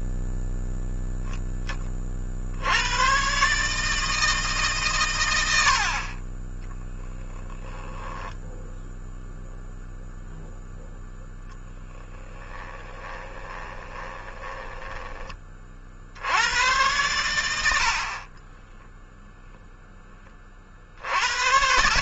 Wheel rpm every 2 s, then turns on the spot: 0, 70, 140, 10, 10, 0, 20, 20, 100, 20, 40.
6-8 12-16 18-20